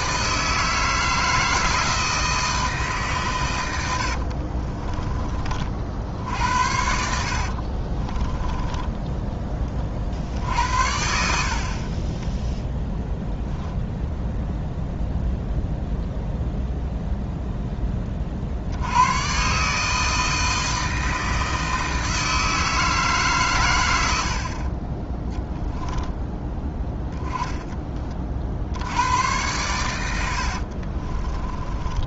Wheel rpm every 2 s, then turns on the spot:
160, 160, 50, 70, 10, 60, 0, 0, 0, 60, 160, 160, 50, 10, 70, 50.
4-10 30-32